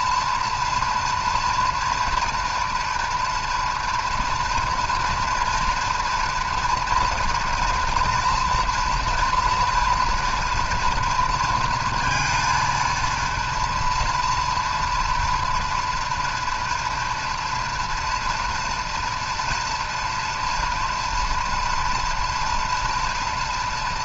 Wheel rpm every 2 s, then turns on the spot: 230, 240, 230, 230, 230, 230, 230, 240, 230, 240, 230, 230.
none